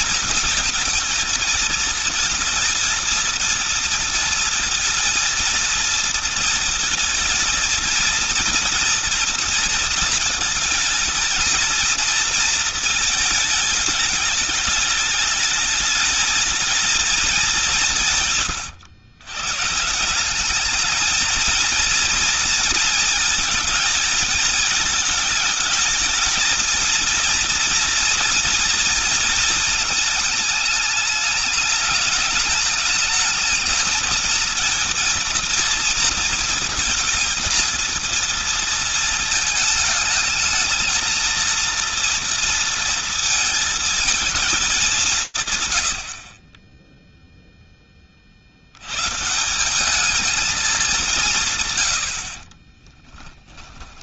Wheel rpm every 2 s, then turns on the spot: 220, 220, 230, 230, 230, 220, 230, 210, 220, 130, 210, 230, 230, 220, 230, 220, 210, 220, 220, 230, 220, 230, 210, 30, 70, 200, 20.
52-54